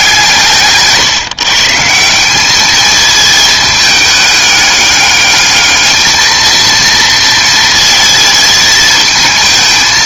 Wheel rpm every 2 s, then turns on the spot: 140, 210, 200, 230, 220.
none